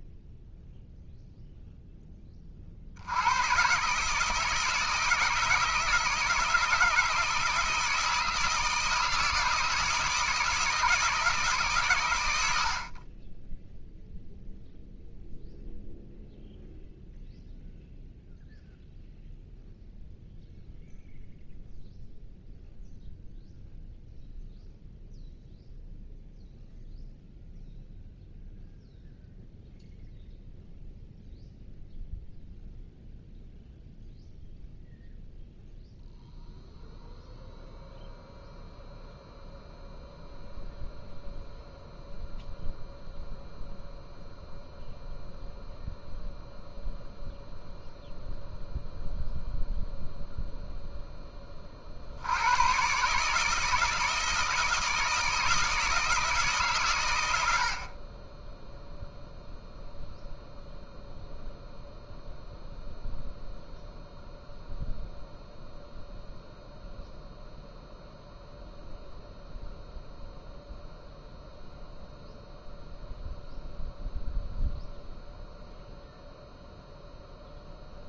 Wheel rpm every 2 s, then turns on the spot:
0, 50, 160, 160, 160, 160, 50, 0, 0, 0, 0, 0, 0, 0, 0, 0, 0, 0, 0, 0, 0, 0, 0, 0, 0, 0, 130, 170, 140, 0, 0, 0, 0, 0, 0, 0, 0, 0, 0.
none